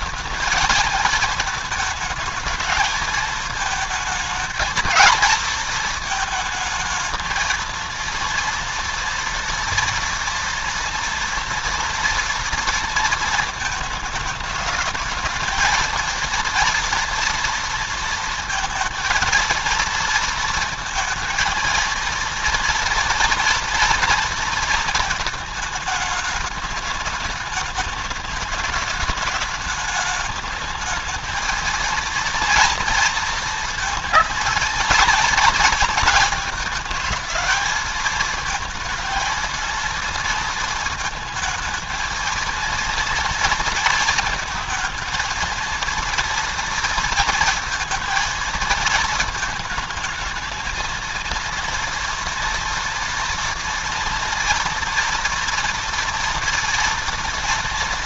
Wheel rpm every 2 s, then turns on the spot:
230, 220, 230, 220, 230, 230, 230, 210, 230, 230, 230, 230, 220, 210, 210, 220, 230, 230, 220, 220, 220, 230, 220, 230, 230, 230, 230, 230, 240.
none